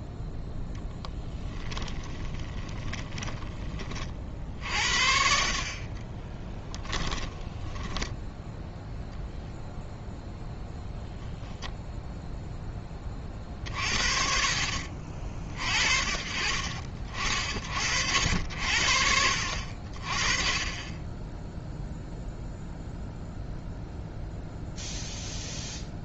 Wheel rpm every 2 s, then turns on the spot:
0, 20, 50, 10, 0, 0, 20, 50, 40, 60, 10, 0, 0.
2-4 6-8